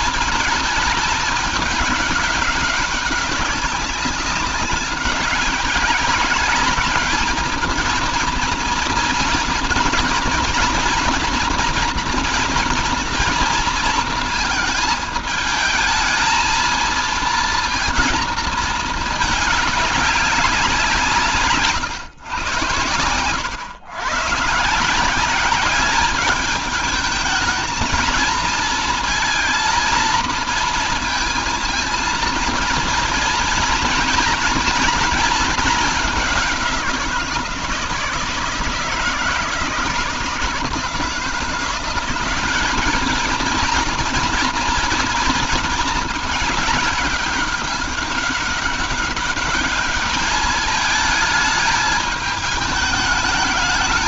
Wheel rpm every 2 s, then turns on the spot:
210, 200, 200, 210, 230, 230, 230, 220, 220, 220, 170, 110, 160, 210, 230, 230, 230, 230, 180, 160, 160, 200, 230, 210, 200, 210, 210.
none